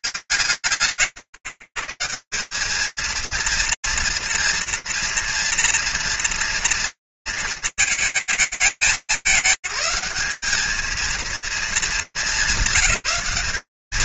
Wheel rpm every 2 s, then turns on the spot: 120, 220, 230, 240, 220, 190, 180.
none